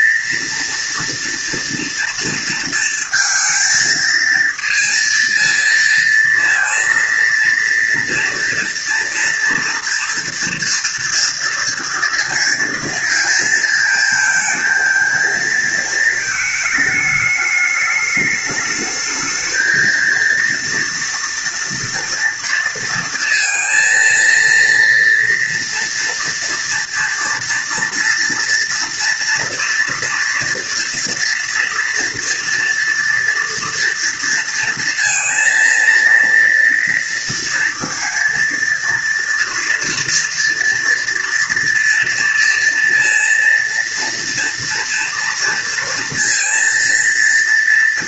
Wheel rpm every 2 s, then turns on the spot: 230, 230, 230, 230, 230, 230, 230, 230, 220, 210, 240, 230, 230, 230, 230, 230, 230, 230, 230, 230, 230, 230, 230, 230.
none